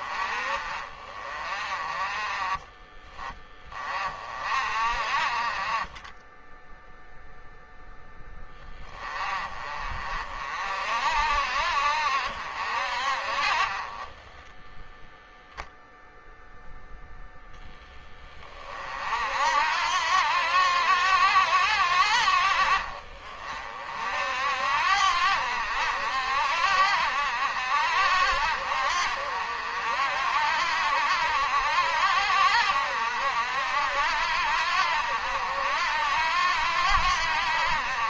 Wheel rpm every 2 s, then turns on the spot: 40, 20, 40, 0, 20, 60, 50, 0, 0, 60, 80, 50, 70, 70, 70, 80, 70, 80, 80.
none